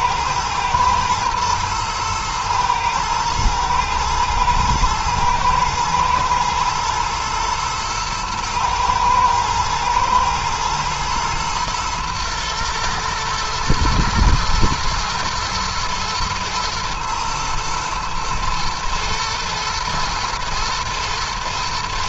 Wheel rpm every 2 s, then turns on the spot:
120, 110, 110, 110, 110, 120, 110, 110, 110, 110, 120.
none